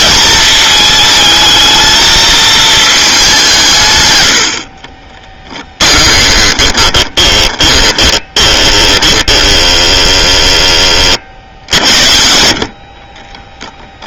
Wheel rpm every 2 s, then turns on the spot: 220, 210, 30, 20, 20, 30, 40.
4-10